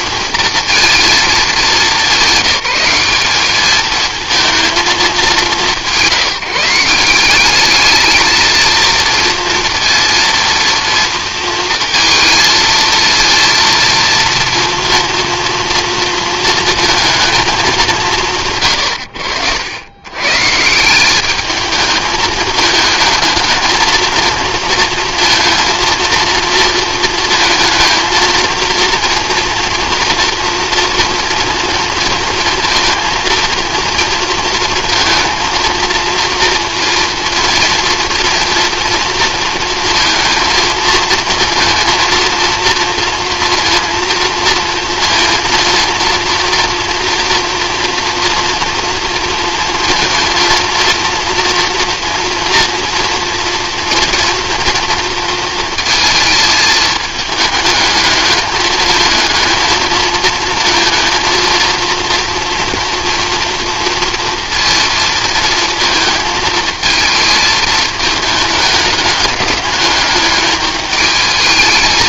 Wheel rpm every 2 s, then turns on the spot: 230, 190, 210, 160, 220, 230, 230, 230, 220, 110, 160, 220, 230, 230, 230, 240, 230, 230, 230, 240, 230, 230, 230, 230, 230, 230, 240, 230, 220, 210, 220, 230, 230, 220, 210, 210.
none